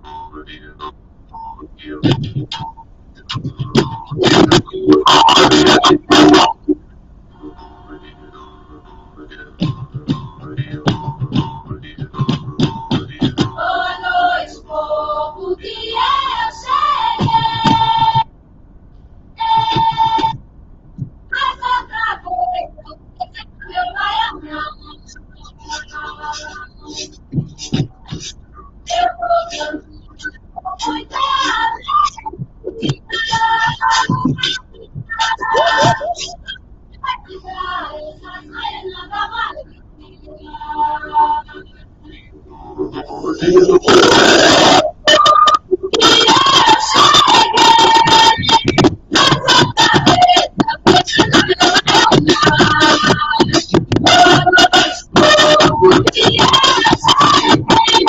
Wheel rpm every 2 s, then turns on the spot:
0, 0, 0, 0, 0, 0, 0, 0, 0, 0, 0, 0, 0, 0, 0, 0, 0, 0, 0, 0, 0, 0, 0, 0, 0, 0, 0, 0, 0.
none